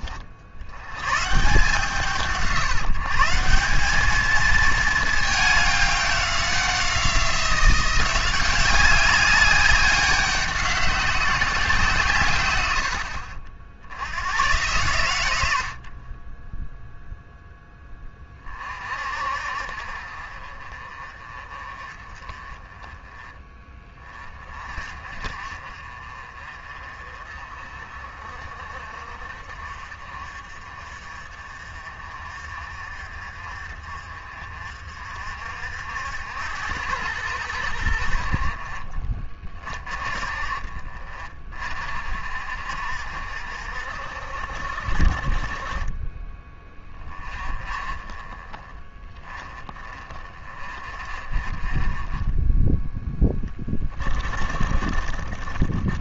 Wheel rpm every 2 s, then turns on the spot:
80, 160, 220, 190, 190, 190, 100, 120, 0, 40, 40, 30, 30, 40, 40, 40, 40, 50, 90, 50, 40, 50, 60, 20, 20, 30, 10, 40.
none